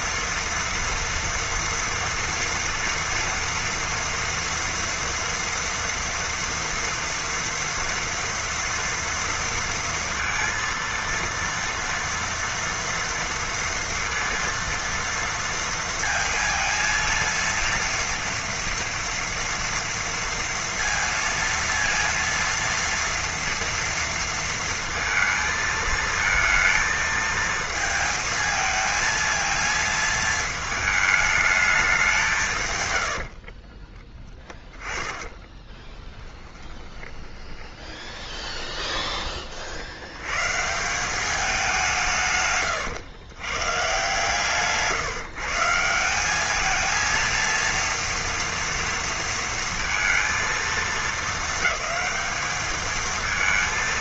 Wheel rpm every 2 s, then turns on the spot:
230, 230, 230, 230, 230, 230, 230, 230, 230, 230, 230, 230, 230, 220, 230, 220, 90, 20, 20, 30, 190, 120, 150, 230, 230, 220, 220.
34-38